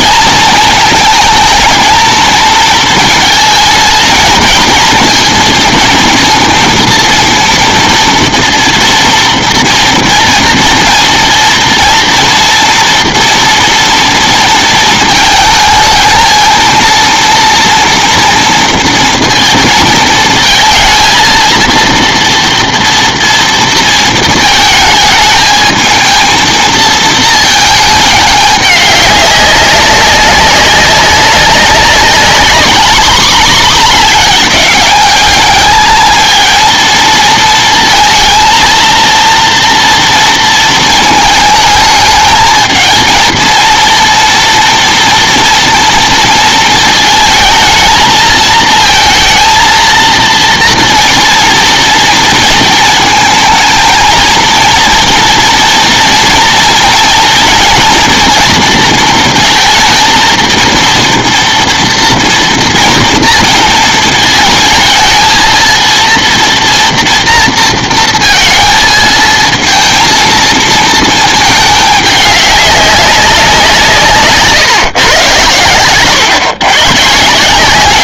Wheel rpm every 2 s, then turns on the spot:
220, 230, 230, 230, 230, 230, 240, 230, 230, 230, 230, 230, 220, 230, 200, 190, 210, 210, 220, 230, 220, 220, 230, 230, 230, 230, 230, 230, 230, 230, 230, 230, 220, 230, 220, 230, 200, 140, 130.
none